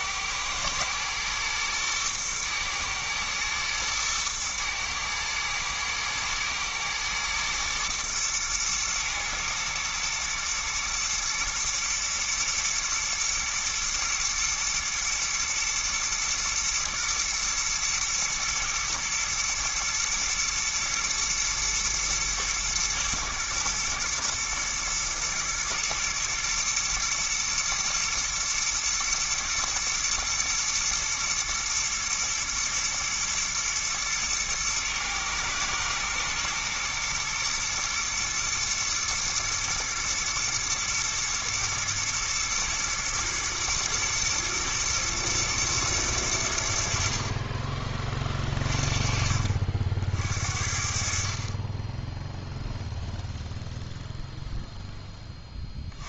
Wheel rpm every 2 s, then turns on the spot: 110, 120, 110, 110, 110, 110, 120, 110, 120, 110, 120, 120, 110, 120, 120, 120, 110, 120, 120, 120, 110, 120, 120, 80, 30, 50, 0, 0.
none